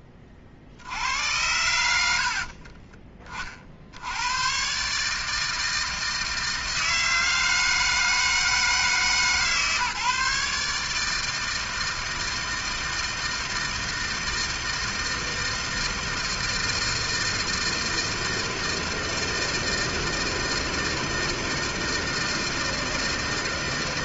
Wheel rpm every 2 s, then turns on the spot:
60, 40, 140, 160, 160, 150, 160, 160, 160, 160, 160, 160.
none